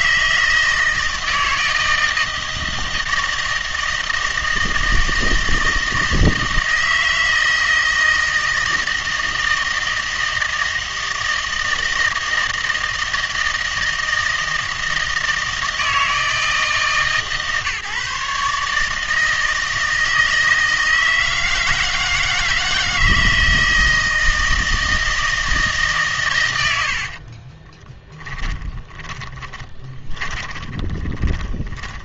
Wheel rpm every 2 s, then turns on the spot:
160, 160, 160, 160, 160, 160, 160, 160, 150, 150, 160, 160, 160, 80, 10, 20.
26-32